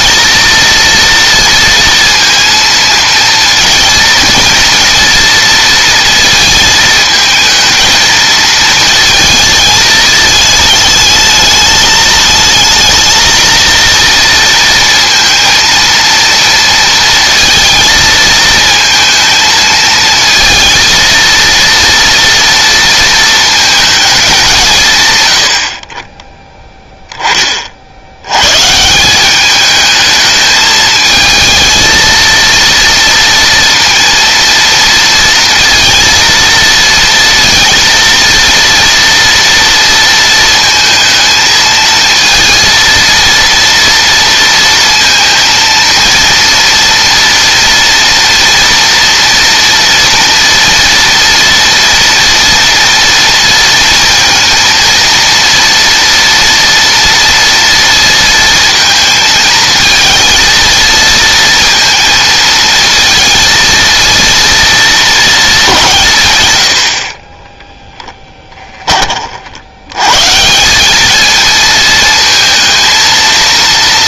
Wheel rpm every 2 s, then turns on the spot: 230, 230, 230, 230, 230, 220, 230, 230, 230, 220, 230, 230, 160, 10, 150, 220, 230, 230, 230, 230, 220, 230, 230, 230, 230, 230, 230, 230, 230, 230, 230, 230, 230, 90, 30, 180, 230.
68-70